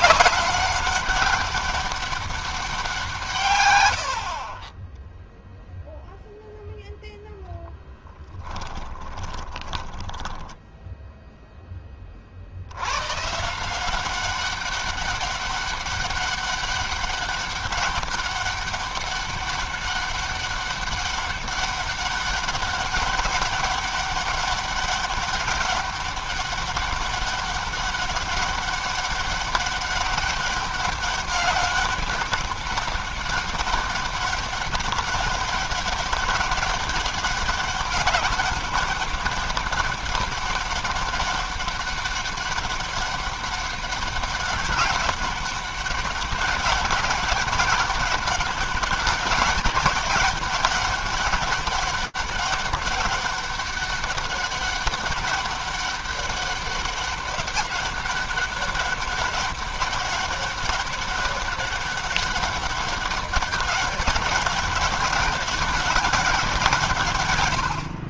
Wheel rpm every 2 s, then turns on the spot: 200, 180, 20, 0, 20, 0, 110, 200, 200, 200, 200, 200, 200, 200, 200, 200, 200, 200, 200, 200, 200, 200, 200, 200, 190, 200, 200, 200, 200, 200, 200, 200, 190, 160.
8-10